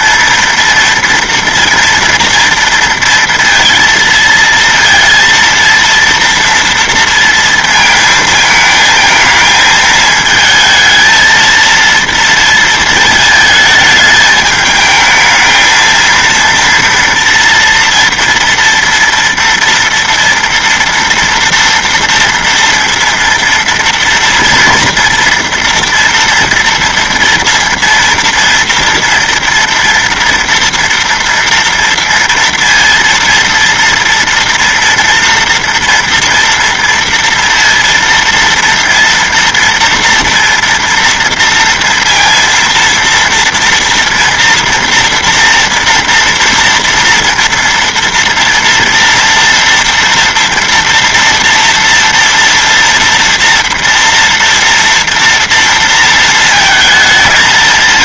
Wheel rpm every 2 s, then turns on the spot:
230, 230, 230, 230, 220, 220, 230, 220, 230, 230, 240, 230, 230, 230, 230, 230, 230, 230, 230, 230, 230, 230, 230, 230, 230, 230, 230, 230, 220.
none